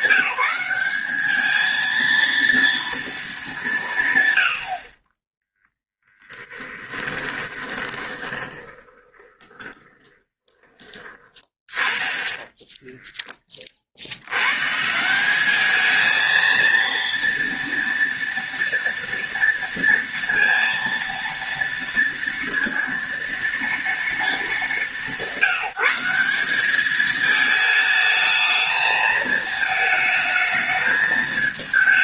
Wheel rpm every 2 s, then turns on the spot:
200, 220, 40, 10, 20, 20, 10, 160, 230, 230, 230, 230, 200, 210, 220, 220.
4-10